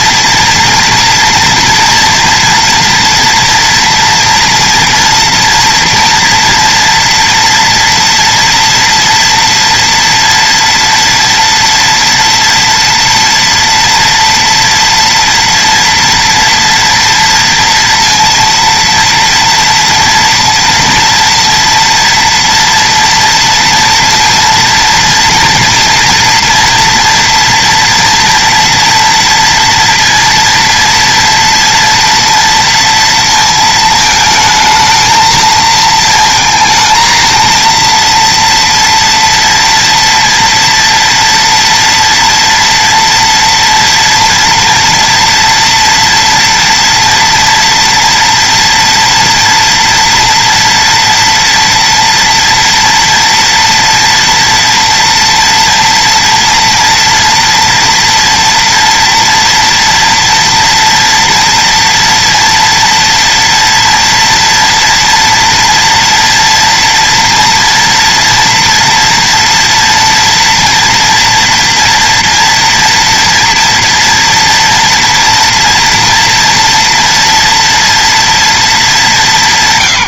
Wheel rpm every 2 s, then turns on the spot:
230, 230, 240, 230, 230, 230, 230, 230, 230, 230, 230, 230, 230, 230, 230, 230, 230, 220, 220, 230, 230, 230, 230, 230, 240, 230, 230, 230, 230, 230, 230, 230, 230, 230, 230, 240, 230, 230, 240, 230.
none